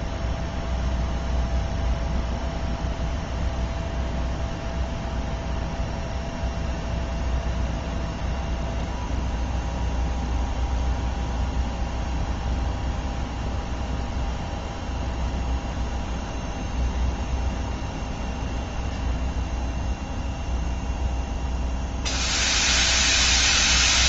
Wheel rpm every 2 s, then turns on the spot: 0, 0, 0, 0, 0, 0, 0, 0, 0, 0, 0, 0.
none